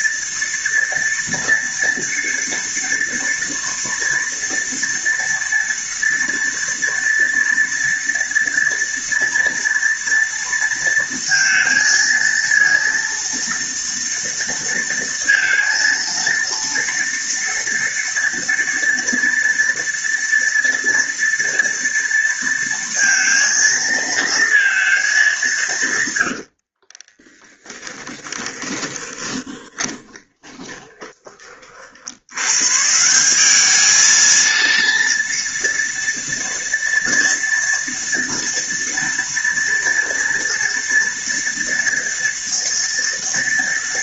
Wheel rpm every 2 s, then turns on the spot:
230, 230, 230, 230, 230, 230, 230, 230, 230, 230, 230, 230, 220, 70, 20, 20, 130, 230, 230, 230, 230, 230.
26-32